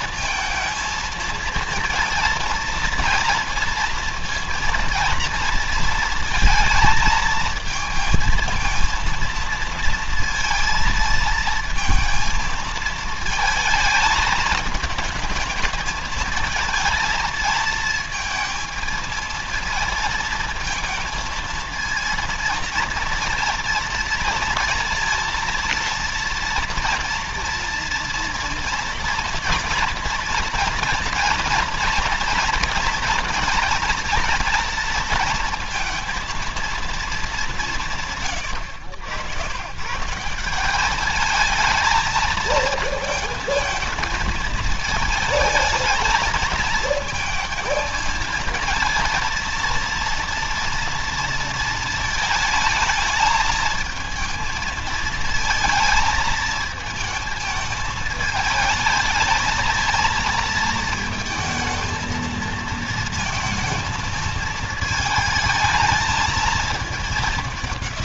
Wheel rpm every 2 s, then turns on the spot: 220, 230, 230, 230, 230, 230, 220, 220, 220, 230, 220, 230, 230, 230, 230, 230, 230, 230, 230, 110, 180, 230, 220, 220, 230, 230, 220, 220, 220, 220, 220, 220, 220, 220.
none